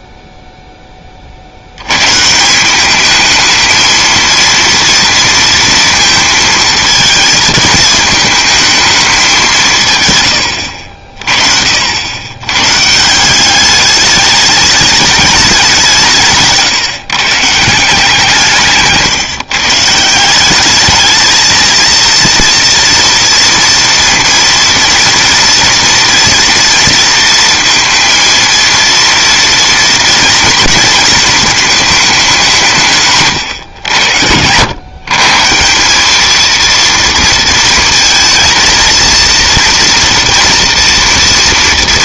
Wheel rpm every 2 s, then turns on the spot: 0, 180, 230, 220, 220, 70, 130, 210, 160, 160, 200, 230, 230, 240, 230, 230, 170, 100, 230, 230, 240.
none